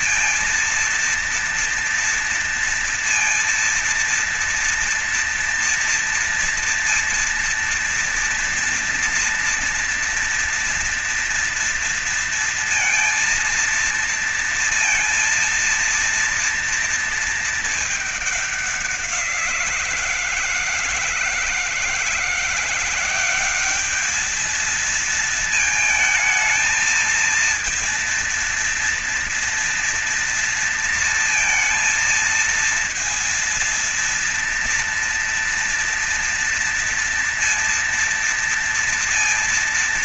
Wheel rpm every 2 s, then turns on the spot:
230, 230, 240, 230, 240, 230, 230, 230, 230, 190, 160, 170, 220, 220, 230, 230, 230, 230, 230, 230.
none